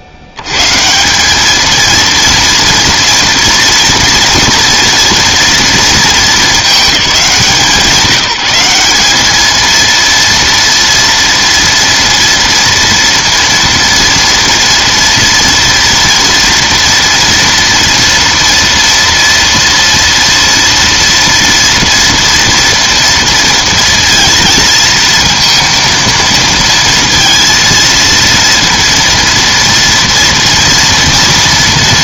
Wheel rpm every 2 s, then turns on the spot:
90, 230, 230, 210, 190, 230, 230, 240, 230, 230, 230, 230, 230, 230, 230, 230.
none